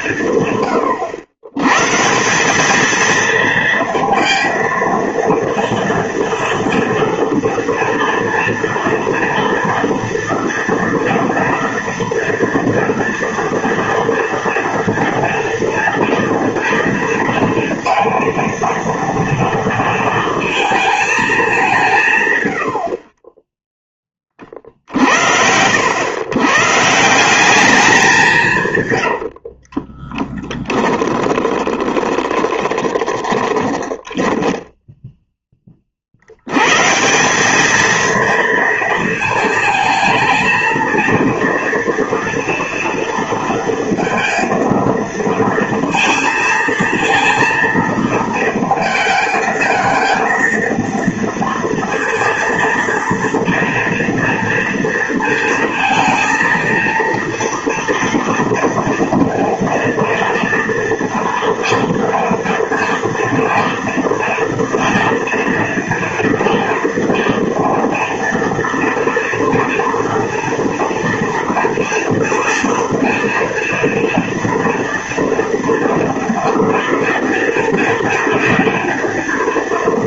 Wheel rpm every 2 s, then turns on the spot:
130, 190, 230, 230, 230, 230, 230, 230, 230, 230, 220, 90, 60, 140, 150, 20, 30, 10, 120, 220, 230, 230, 230, 230, 230, 230, 230, 230, 230, 230, 230, 230, 240, 230, 230, 230, 240, 230, 230, 230.
28-34